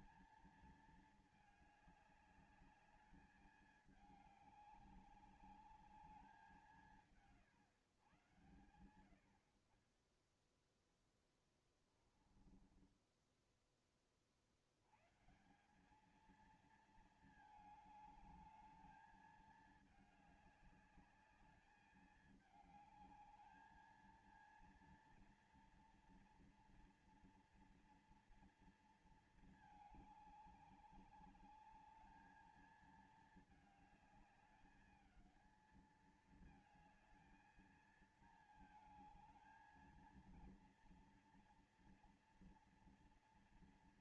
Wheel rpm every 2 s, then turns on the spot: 220, 210, 200, 190, 120, 10, 20, 50, 210, 210, 210, 210, 220, 230, 230, 210, 210, 210, 220, 220, 220, 240.
12-14